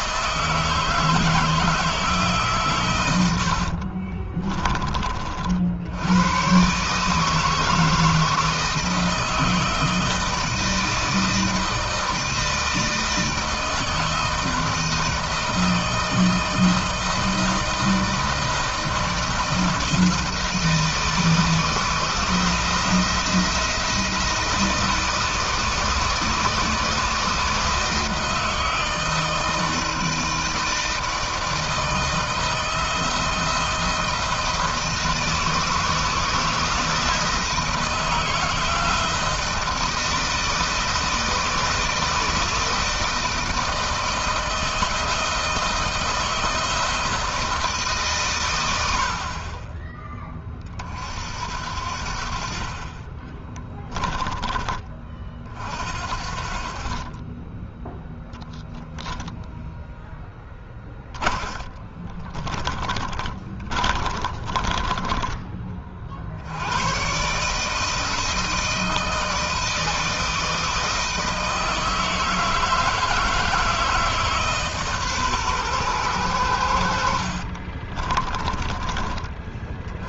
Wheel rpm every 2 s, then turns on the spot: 160, 110, 30, 140, 160, 160, 160, 160, 160, 160, 160, 170, 160, 160, 160, 160, 160, 160, 160, 170, 160, 160, 160, 160, 70, 50, 30, 30, 30, 0, 10, 20, 20, 110, 160, 160, 160, 140, 70, 30.
52-54 60-66 76-78